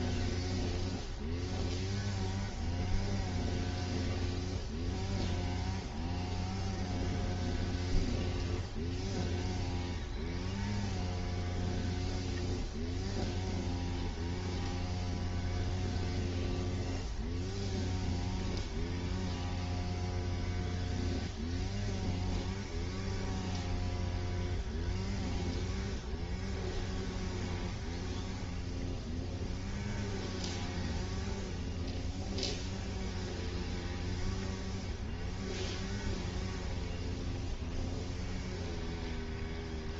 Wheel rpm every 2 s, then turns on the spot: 0, 0, 0, 0, 0, 0, 0, 0, 0, 0, 0, 0, 0, 0, 0, 0, 0, 0, 0, 0.
none